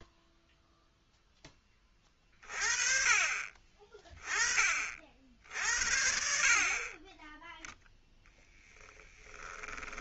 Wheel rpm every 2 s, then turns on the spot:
0, 30, 50, 30, 10.
8-10